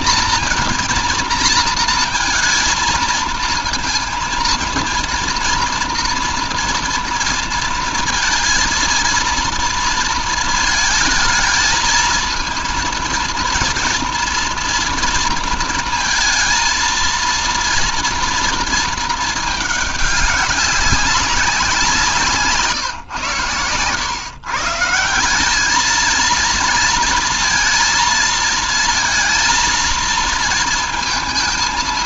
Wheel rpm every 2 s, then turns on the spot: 230, 230, 230, 230, 230, 230, 230, 230, 230, 220, 190, 140, 170, 230, 230, 230.
none